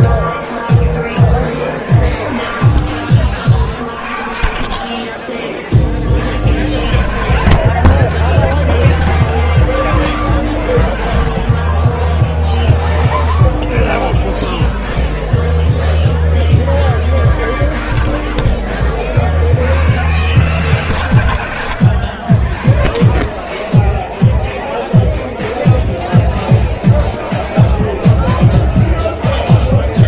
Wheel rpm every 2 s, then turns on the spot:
0, 20, 50, 40, 130, 90, 10, 0, 10, 40, 120, 50, 0, 0, 0.
none